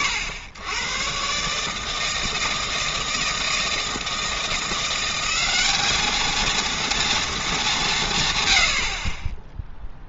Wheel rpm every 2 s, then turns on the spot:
100, 160, 170, 230, 90.
none